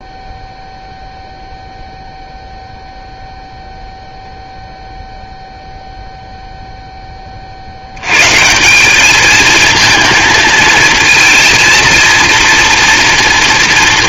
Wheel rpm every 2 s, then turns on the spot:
0, 0, 0, 0, 110, 230, 230.
none